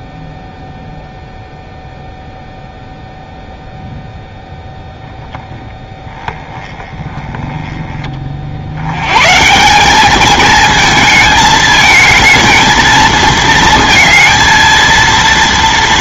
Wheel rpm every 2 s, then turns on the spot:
0, 0, 0, 10, 60, 220, 220, 230.
none